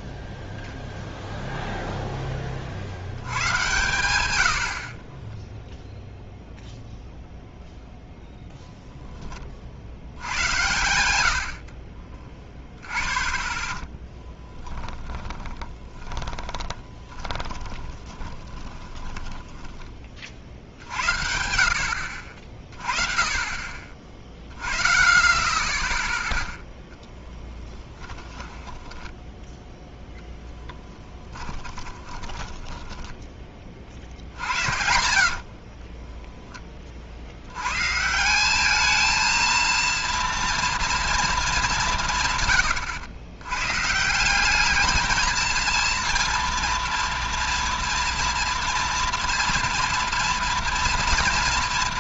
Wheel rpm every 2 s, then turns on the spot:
0, 40, 100, 0, 0, 110, 10, 10, 20, 20, 60, 40, 20, 0, 10, 0, 10, 60, 10, 200, 230, 130, 210, 230, 230, 230.
16-20 28-30 32-36